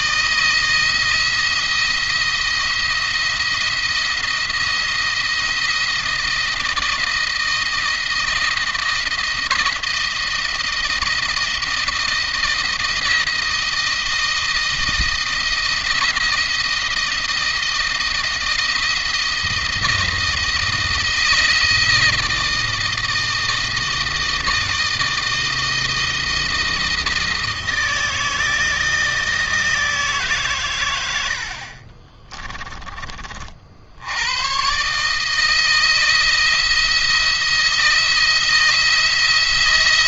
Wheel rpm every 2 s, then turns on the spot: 160, 170, 170, 170, 170, 160, 160, 160, 170, 170, 160, 160, 160, 160, 160, 100, 20, 140, 170, 170.
none